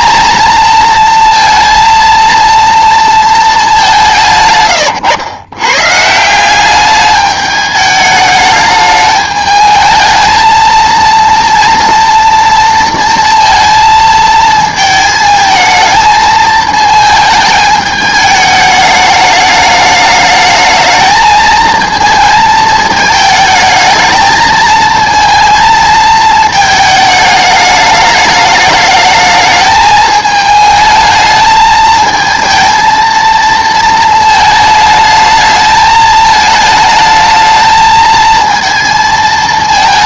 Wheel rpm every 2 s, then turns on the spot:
230, 230, 130, 190, 210, 220, 230, 220, 220, 210, 210, 220, 220, 220, 210, 220, 220, 220, 220, 230.
none